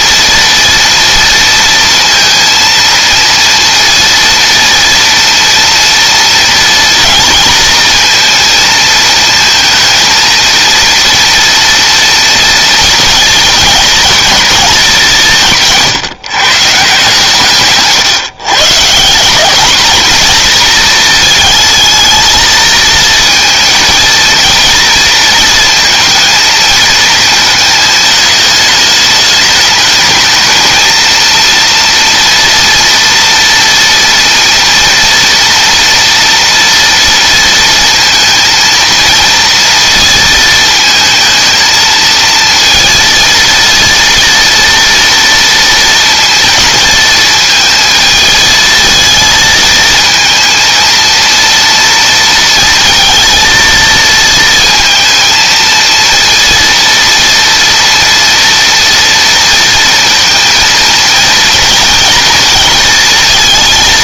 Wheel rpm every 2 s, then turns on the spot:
230, 230, 230, 230, 220, 230, 230, 190, 130, 170, 230, 230, 230, 220, 210, 230, 230, 230, 230, 230, 220, 230, 230, 220, 220, 230, 230, 220, 230, 230, 230, 230.
none